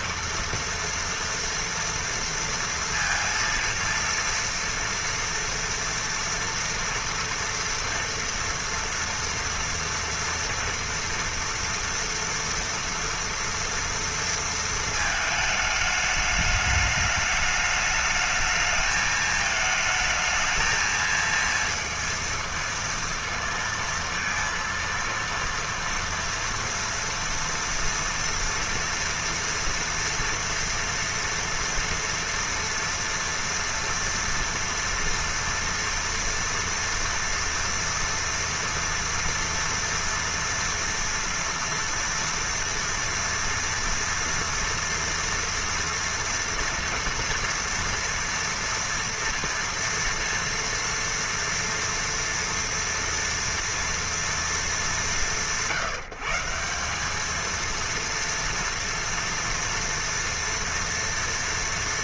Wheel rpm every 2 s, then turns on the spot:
230, 230, 230, 230, 230, 230, 240, 220, 210, 220, 220, 230, 230, 240, 230, 230, 230, 230, 230, 230, 230, 230, 230, 230, 230, 230, 230, 210, 180, 230, 230.
none